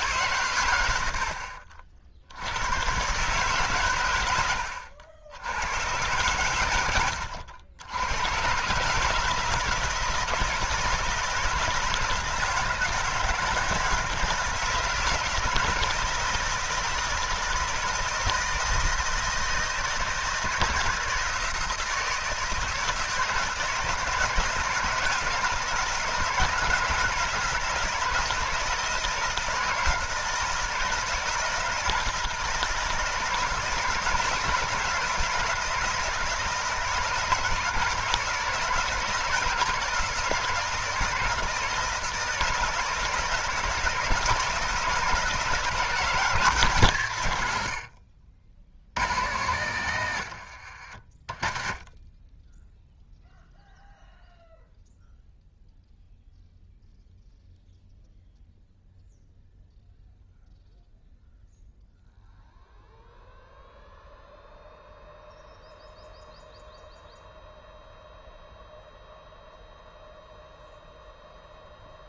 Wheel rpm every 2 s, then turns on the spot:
100, 110, 90, 90, 150, 170, 160, 160, 160, 160, 160, 160, 160, 160, 160, 160, 160, 170, 160, 170, 160, 160, 160, 150, 100, 60, 10, 0, 0, 0, 0, 0, 0, 0, 0, 0.
none